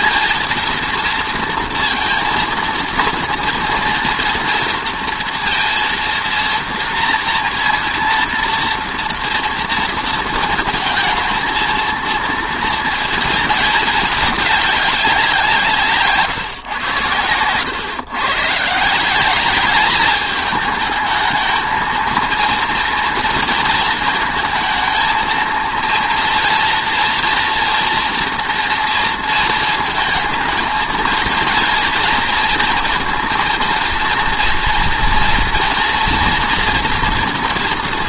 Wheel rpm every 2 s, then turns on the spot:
230, 230, 230, 230, 230, 230, 230, 200, 120, 140, 210, 230, 220, 230, 240, 220, 230, 230, 230.
none